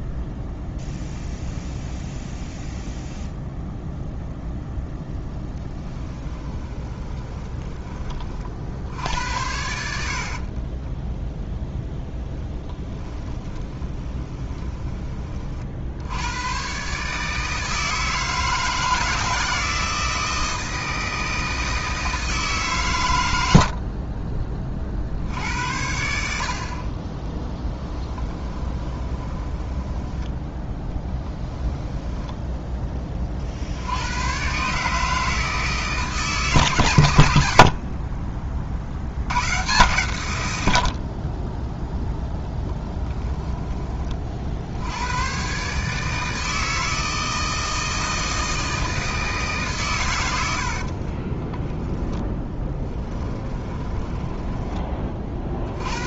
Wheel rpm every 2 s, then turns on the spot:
0, 0, 0, 20, 60, 20, 10, 20, 130, 160, 160, 130, 40, 50, 20, 10, 10, 140, 130, 60, 80, 10, 70, 160, 160, 70, 10, 20.
6-8 10-16 28-30 42-44 52-54